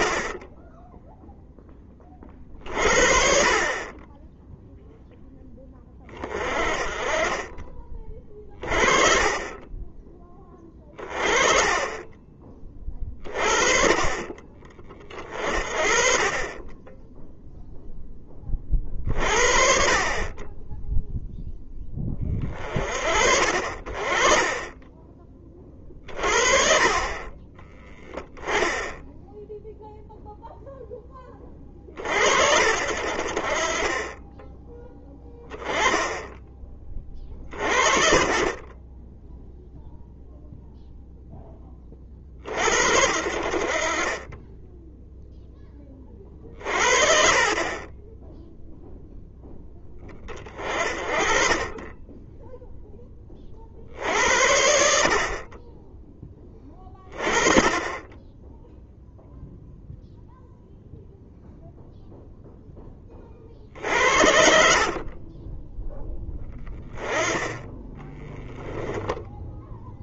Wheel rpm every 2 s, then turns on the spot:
10, 50, 0, 20, 40, 20, 20, 30, 10, 40, 10, 30, 20, 40, 10, 0, 50, 10, 20, 20, 0, 60, 10, 50, 0, 40, 10, 60, 20, 0, 0, 10, 40, 20, 0.
8-10 28-30 64-66